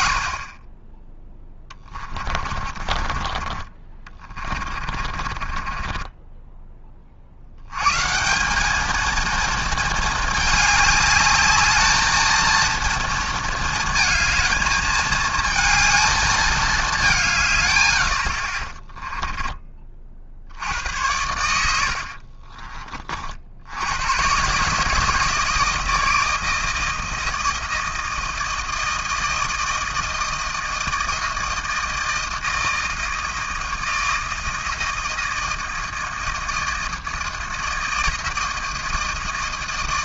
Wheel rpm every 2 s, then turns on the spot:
10, 40, 50, 30, 220, 210, 230, 220, 190, 20, 80, 40, 160, 160, 160, 160, 160, 160, 160, 160.
2-6 18-20